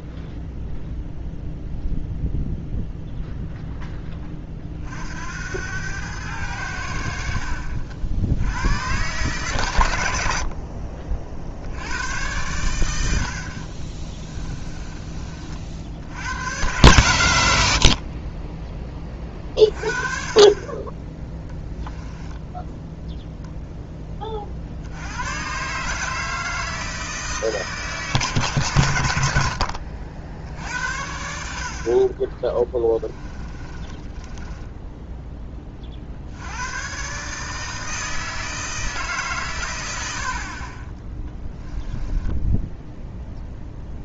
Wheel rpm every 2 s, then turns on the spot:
0, 0, 40, 90, 100, 50, 100, 20, 120, 20, 20, 0, 40, 160, 130, 80, 20, 10, 100, 160, 30, 10.
14-16 32-36 40-42